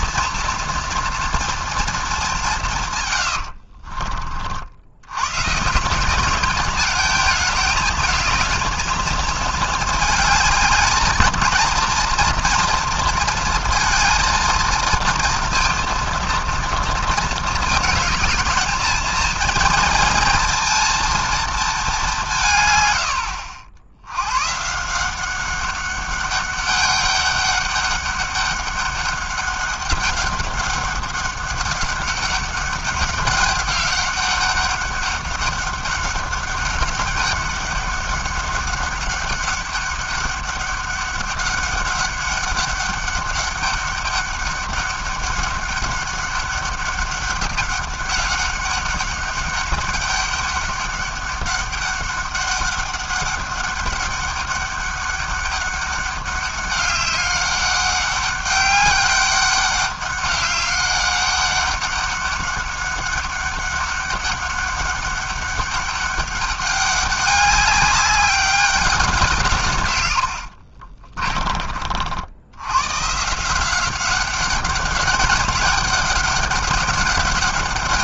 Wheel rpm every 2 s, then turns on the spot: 230, 170, 70, 210, 220, 210, 230, 230, 230, 220, 230, 140, 130, 200, 200, 200, 200, 200, 200, 200, 200, 200, 200, 200, 190, 200, 190, 200, 200, 200, 200, 200, 200, 200, 200, 80, 100, 200, 200.
70-72